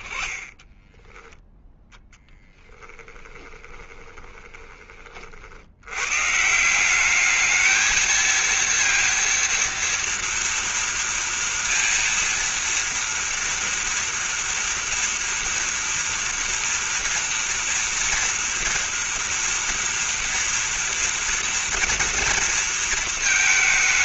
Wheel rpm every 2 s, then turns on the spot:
20, 10, 30, 180, 230, 230, 230, 240, 240, 230, 230, 230.
2-4